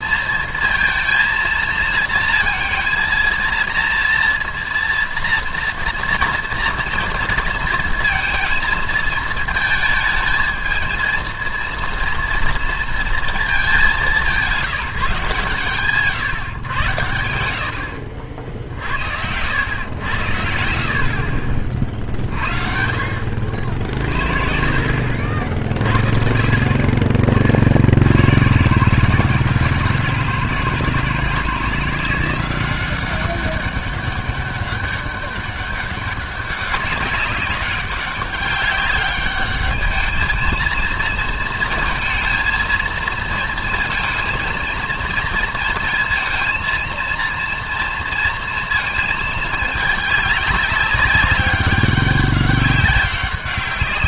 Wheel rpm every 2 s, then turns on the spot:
230, 230, 230, 230, 220, 220, 230, 180, 120, 60, 70, 50, 50, 40, 130, 150, 180, 200, 200, 200, 220, 230, 230, 230, 220, 200, 190.
20-22